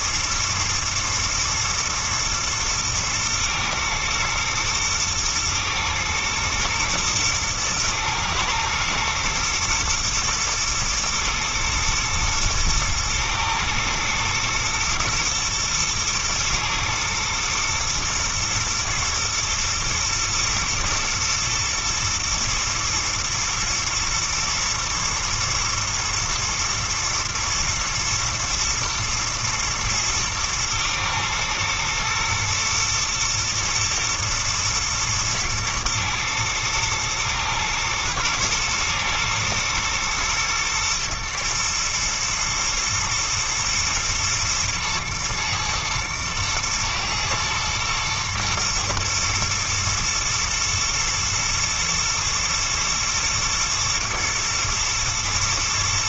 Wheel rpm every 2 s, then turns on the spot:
110, 110, 120, 110, 110, 110, 120, 110, 110, 120, 110, 120, 110, 120, 120, 110, 110, 110, 110, 110, 110, 120, 110, 110, 120, 110, 110, 110.
none